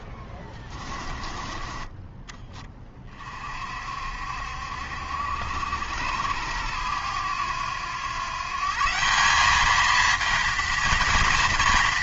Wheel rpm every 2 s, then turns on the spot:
20, 20, 70, 90, 140, 230.
0-2